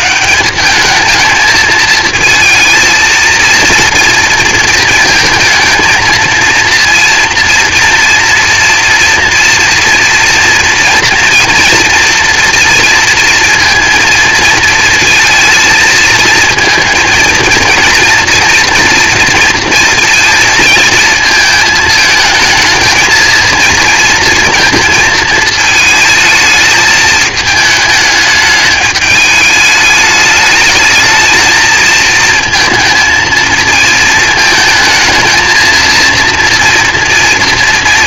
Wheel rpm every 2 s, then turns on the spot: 200, 220, 220, 230, 230, 230, 230, 220, 220, 230, 230, 220, 230, 220, 210, 220, 230, 220, 240.
none